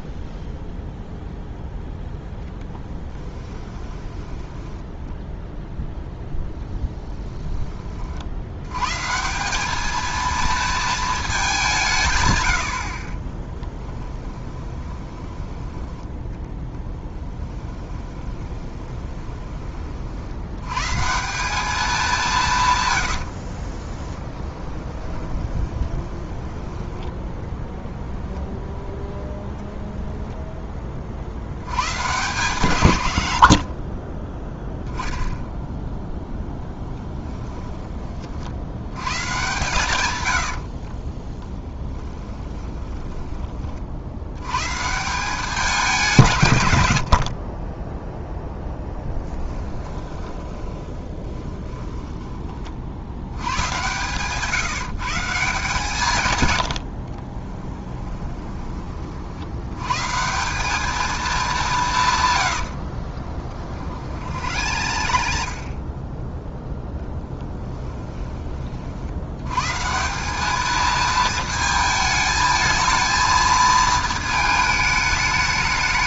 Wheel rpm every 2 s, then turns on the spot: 0, 10, 10, 0, 110, 230, 80, 20, 10, 20, 120, 120, 20, 10, 10, 20, 120, 0, 10, 80, 30, 20, 140, 110, 0, 20, 30, 150, 80, 20, 190, 70, 80, 0, 40, 220, 220, 220.
4-6 14-20 24-26 40-44 50-52 62-66